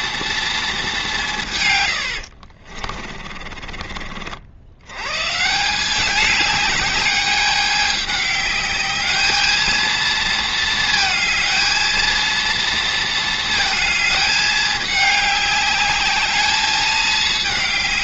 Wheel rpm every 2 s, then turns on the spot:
230, 50, 70, 200, 210, 220, 230, 210, 210.
2-4